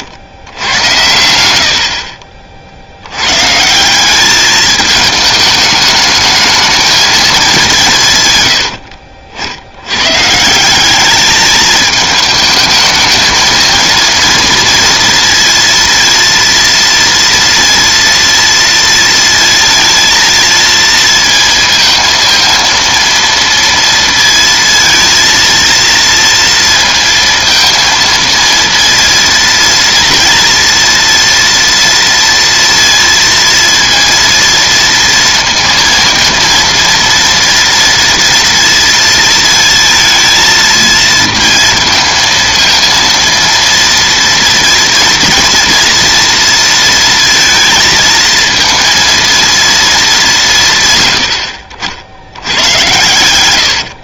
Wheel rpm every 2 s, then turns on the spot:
100, 60, 210, 220, 100, 170, 220, 230, 230, 230, 230, 230, 230, 230, 230, 230, 230, 230, 230, 230, 230, 230, 230, 230, 230, 150, 100.
none